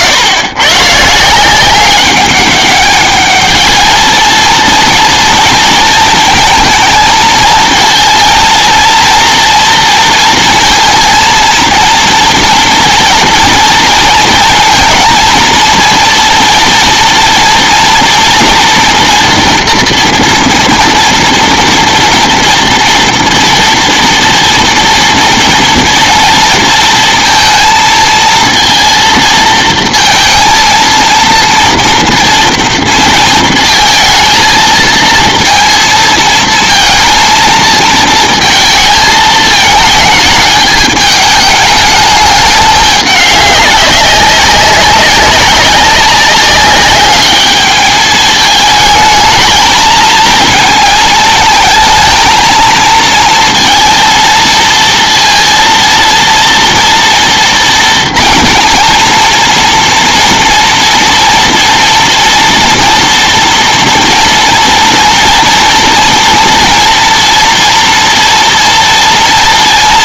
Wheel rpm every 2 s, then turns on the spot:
130, 200, 230, 230, 230, 230, 230, 230, 230, 230, 230, 230, 230, 230, 230, 230, 230, 220, 230, 220, 210, 210, 200, 200, 220, 220, 220, 230, 230, 230, 240, 230, 230, 230, 230.
none